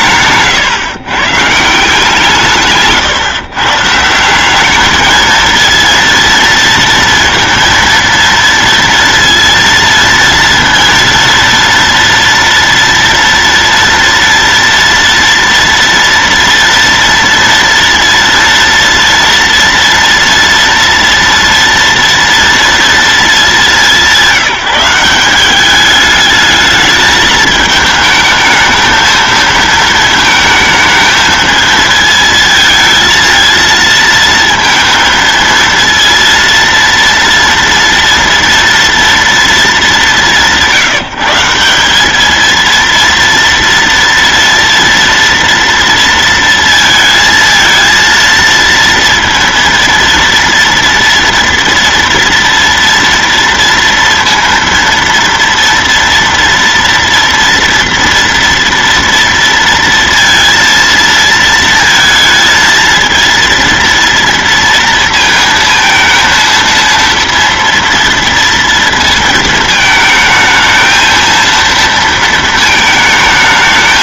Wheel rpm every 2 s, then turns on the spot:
140, 150, 200, 230, 230, 230, 230, 230, 230, 230, 230, 230, 180, 210, 220, 220, 220, 230, 230, 230, 170, 230, 230, 230, 230, 230, 230, 230, 230, 230, 230, 230, 230, 230, 230, 220, 220.
none